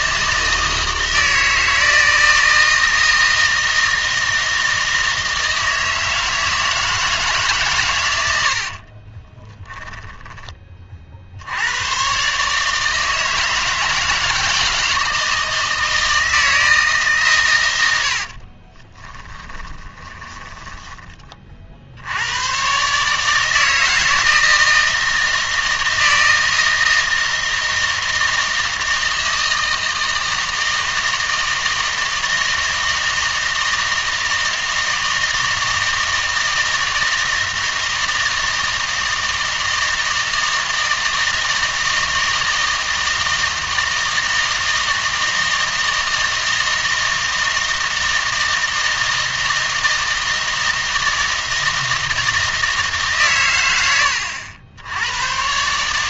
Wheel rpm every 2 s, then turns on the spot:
160, 160, 160, 160, 50, 30, 150, 160, 160, 30, 20, 130, 160, 160, 160, 160, 160, 160, 160, 160, 160, 160, 160, 160, 160, 160, 160, 90.
8-10 18-22